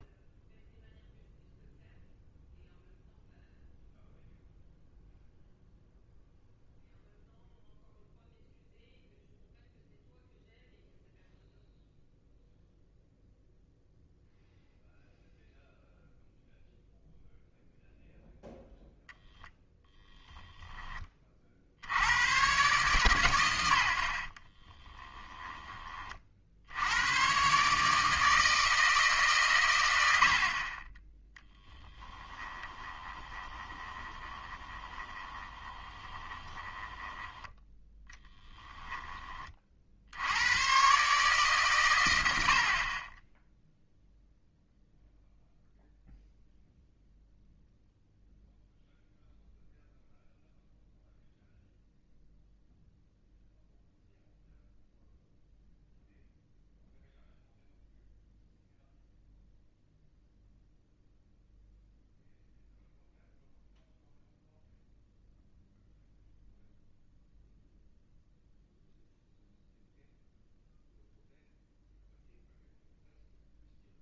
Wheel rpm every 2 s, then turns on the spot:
0, 0, 0, 0, 0, 0, 0, 0, 0, 0, 10, 120, 20, 70, 160, 50, 20, 20, 20, 10, 110, 60, 0, 0, 0, 0, 0, 0, 0, 0, 0, 0, 0, 0, 0, 0, 0.
24-26 32-38